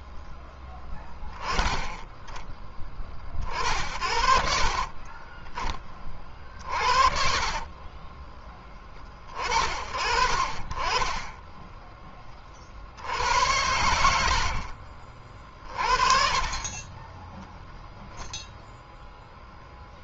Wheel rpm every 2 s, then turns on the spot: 10, 30, 30, 40, 30, 30, 80, 50, 20, 0.
4-6 10-12 16-18